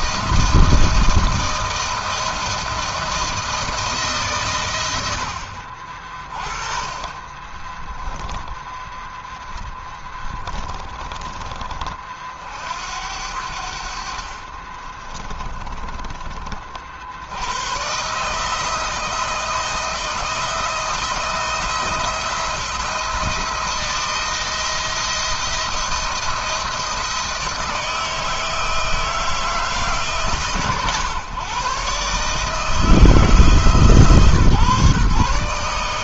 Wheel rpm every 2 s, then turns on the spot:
160, 160, 80, 20, 10, 20, 70, 40, 70, 170, 170, 170, 170, 160, 160, 130, 160, 140.
14-16